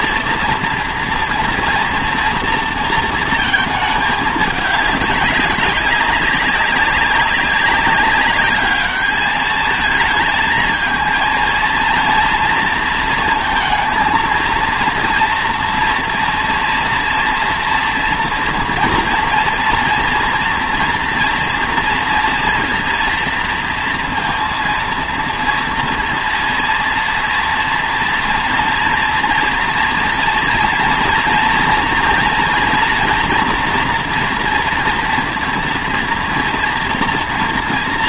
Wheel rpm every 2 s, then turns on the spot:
230, 230, 210, 200, 210, 220, 230, 230, 230, 230, 240, 230, 230, 230, 230, 230, 230, 230, 230.
none